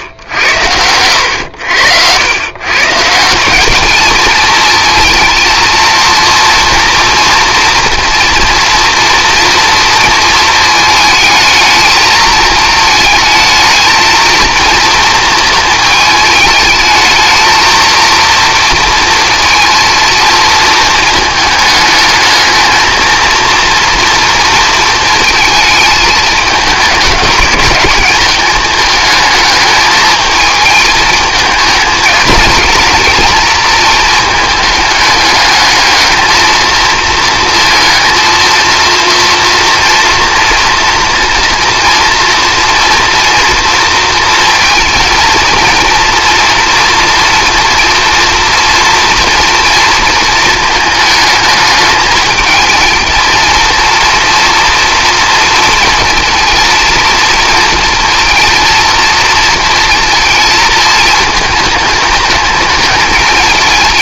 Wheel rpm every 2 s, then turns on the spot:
90, 130, 230, 240, 230, 220, 220, 230, 220, 230, 220, 220, 230, 210, 220, 220, 220, 220, 220, 230, 230, 230, 230, 240, 230, 220, 220, 230, 230, 230, 220, 210.
none